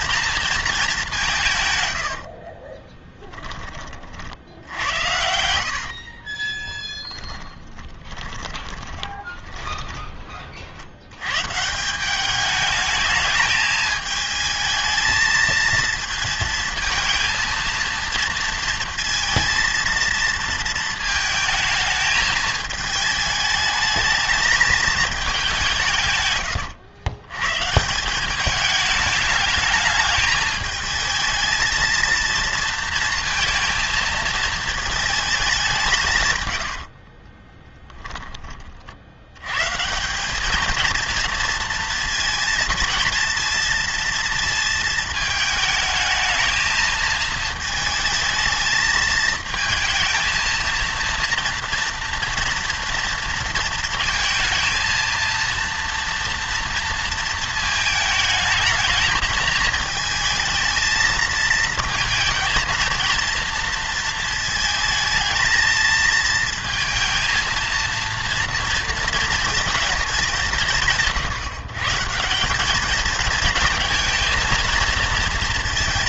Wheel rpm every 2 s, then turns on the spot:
220, 30, 80, 20, 20, 50, 210, 220, 230, 230, 230, 220, 220, 110, 210, 210, 230, 220, 110, 20, 220, 230, 230, 220, 220, 230, 240, 230, 230, 220, 220, 230, 220, 230, 230, 170, 200, 220.
2-4 6-10 36-38